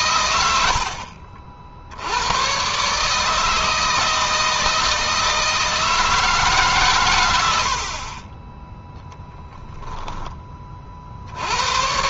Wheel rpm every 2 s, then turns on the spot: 80, 120, 160, 140, 10, 30.
none